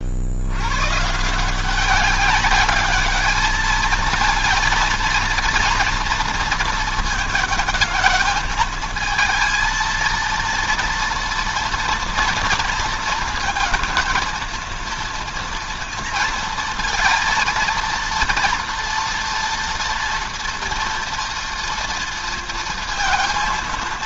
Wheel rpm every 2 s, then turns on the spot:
130, 210, 230, 220, 220, 230, 240, 230, 230, 230, 230, 230.
none